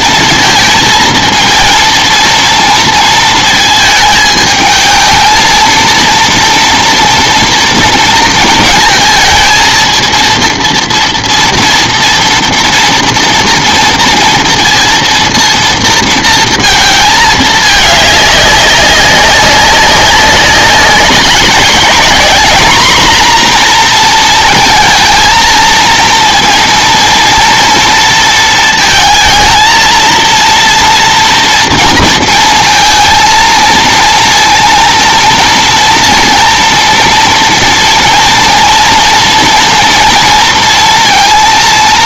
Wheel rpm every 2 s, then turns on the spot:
230, 230, 220, 230, 220, 230, 230, 230, 220, 200, 200, 230, 230, 230, 230, 240, 230, 240, 230, 230, 230.
none